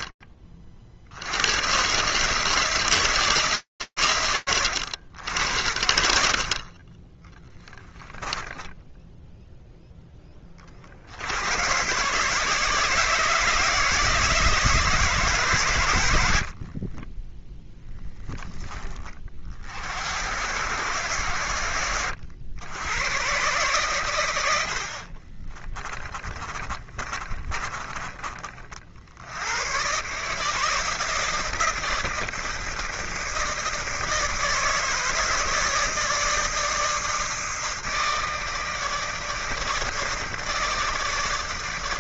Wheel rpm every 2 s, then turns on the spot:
50, 160, 80, 40, 10, 90, 160, 140, 20, 50, 90, 120, 30, 30, 100, 160, 160, 160, 160, 150, 150.
16-18 24-28